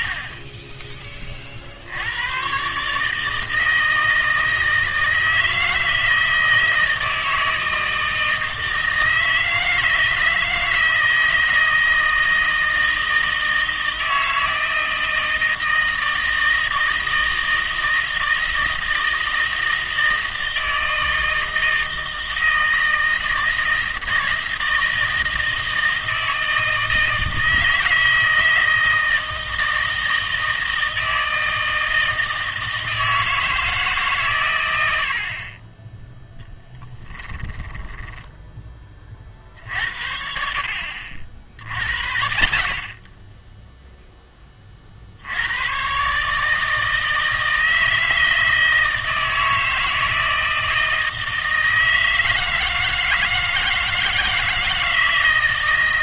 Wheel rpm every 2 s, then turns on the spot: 10, 140, 160, 160, 160, 160, 160, 160, 160, 160, 160, 160, 160, 160, 160, 160, 160, 90, 10, 20, 60, 60, 40, 160, 160, 160, 160, 160.
36-38